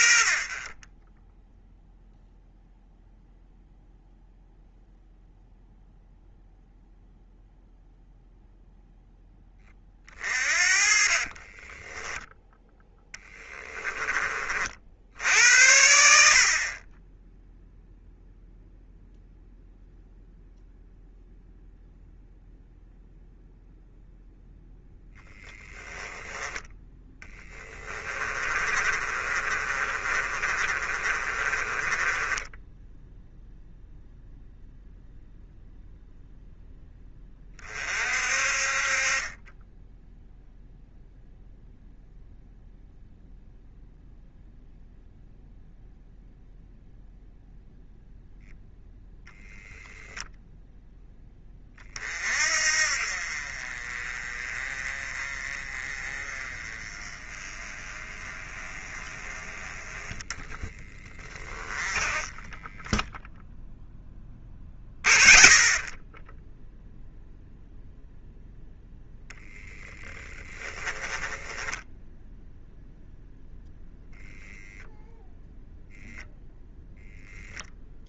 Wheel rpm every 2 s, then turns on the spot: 30, 0, 0, 0, 0, 40, 0, 50, 40, 0, 0, 0, 10, 10, 30, 30, 10, 0, 0, 40, 0, 0, 0, 0, 10, 10, 50, 30, 30, 30, 10, 10, 30, 0, 0, 20, 0, 0, 0.
28-34 70-72